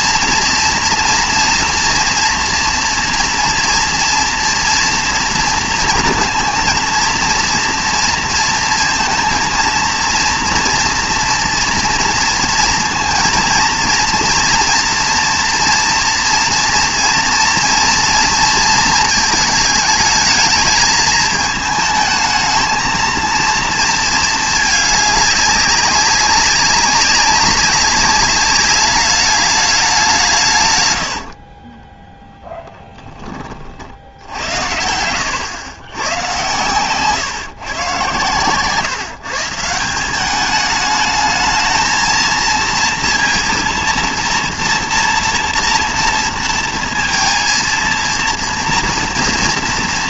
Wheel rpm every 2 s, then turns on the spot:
230, 230, 230, 230, 230, 230, 230, 230, 230, 230, 210, 220, 210, 200, 200, 130, 10, 80, 120, 120, 200, 230, 230, 230, 230.
38-40